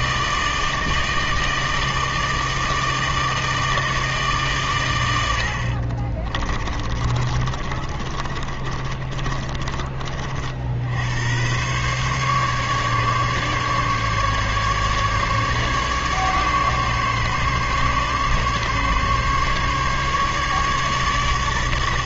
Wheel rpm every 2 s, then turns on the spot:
160, 160, 140, 30, 30, 70, 140, 150, 140, 140, 150.
6-10